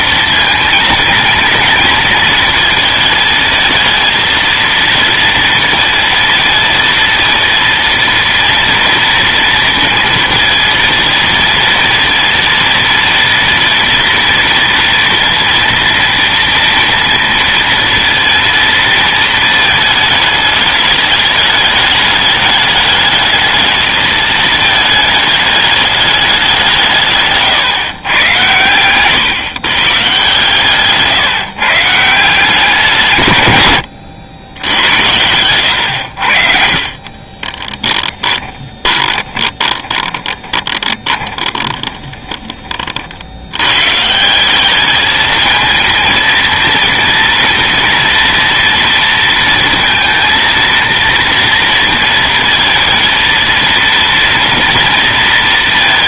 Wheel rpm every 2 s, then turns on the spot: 230, 220, 230, 230, 230, 230, 230, 230, 230, 230, 210, 210, 220, 160, 120, 140, 150, 90, 50, 20, 20, 20, 200, 230, 230, 230, 230, 230.
36-42